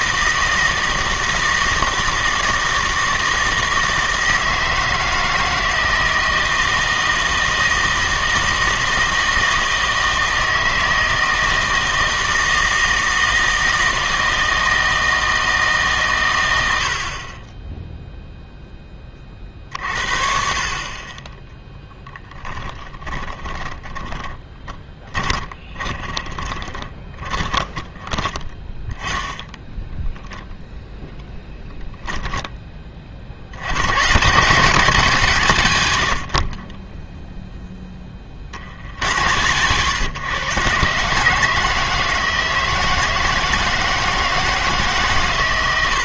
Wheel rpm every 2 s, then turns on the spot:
160, 160, 160, 160, 160, 160, 160, 160, 90, 10, 40, 10, 10, 20, 10, 0, 20, 150, 20, 60, 130, 160, 150.
22-28